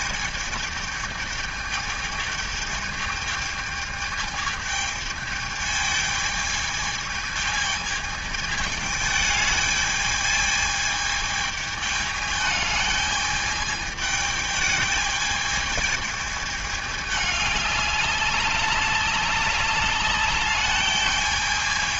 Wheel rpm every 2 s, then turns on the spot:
220, 220, 210, 220, 210, 220, 210, 210, 210, 200, 210.
none